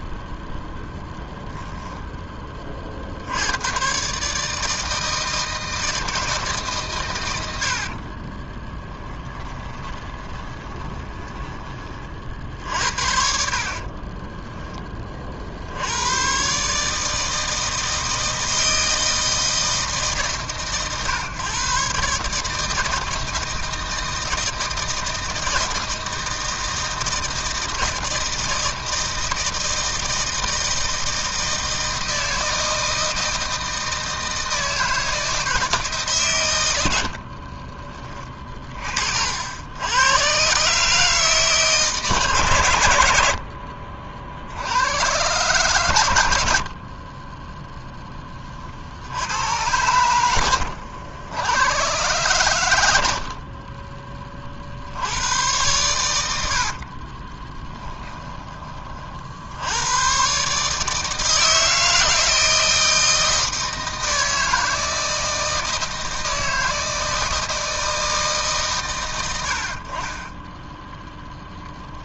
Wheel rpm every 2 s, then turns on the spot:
0, 30, 160, 140, 20, 20, 60, 10, 130, 160, 120, 160, 160, 160, 160, 160, 160, 160, 100, 40, 140, 120, 90, 50, 60, 80, 110, 60, 60, 30, 150, 160, 160, 160, 100, 10.
8-12 56-58